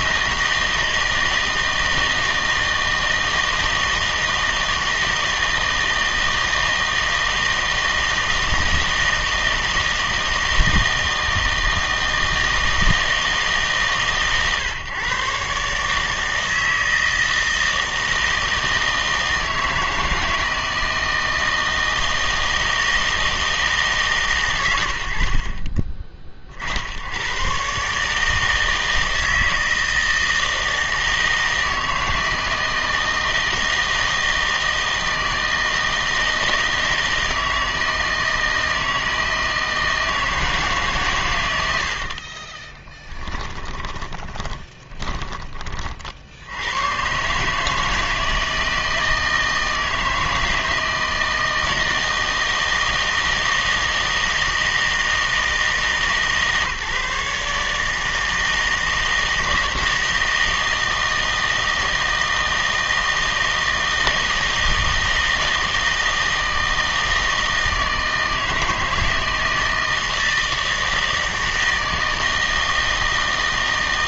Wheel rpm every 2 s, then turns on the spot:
160, 160, 160, 160, 160, 160, 160, 130, 160, 160, 160, 160, 120, 50, 160, 160, 160, 160, 160, 160, 150, 20, 20, 90, 160, 160, 160, 160, 150, 160, 160, 160, 160, 160, 160, 160, 160.
42-46